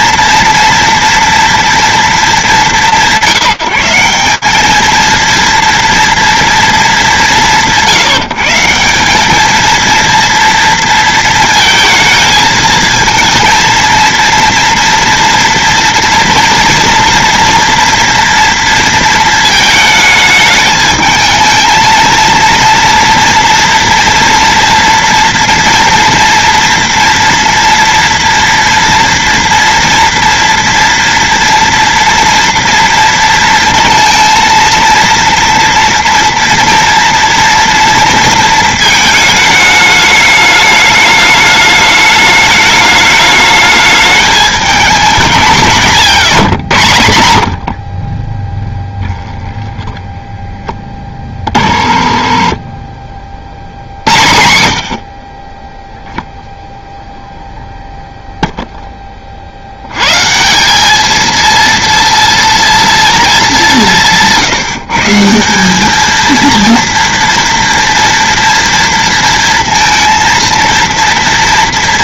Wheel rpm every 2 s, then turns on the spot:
230, 180, 210, 220, 170, 230, 220, 230, 230, 230, 210, 230, 230, 230, 230, 240, 230, 230, 230, 220, 210, 210, 210, 100, 10, 10, 30, 60, 0, 10, 190, 230, 160, 230, 230, 230.
48-50